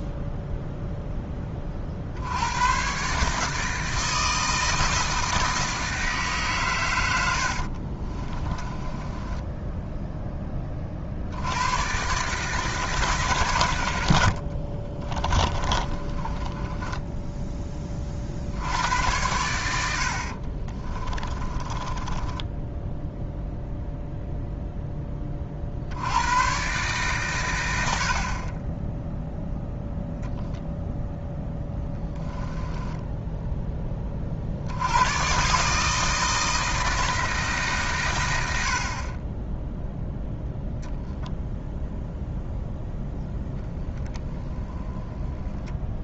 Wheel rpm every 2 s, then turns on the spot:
0, 110, 160, 130, 20, 30, 150, 40, 10, 70, 40, 10, 0, 120, 30, 0, 10, 70, 160, 80, 0, 0, 10.
8-10 14-18 20-24 32-34